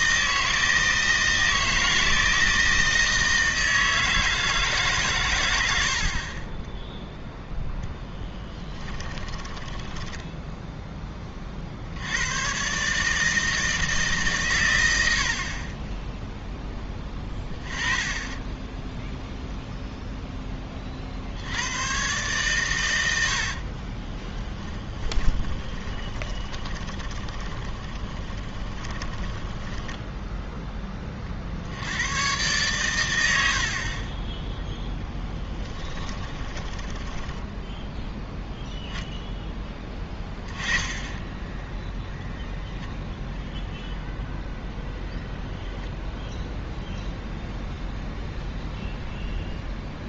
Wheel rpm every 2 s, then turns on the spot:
160, 160, 160, 30, 10, 10, 120, 120, 0, 20, 10, 130, 20, 20, 10, 10, 110, 10, 20, 0, 10, 0, 0, 0, 0.
8-12 24-32 36-38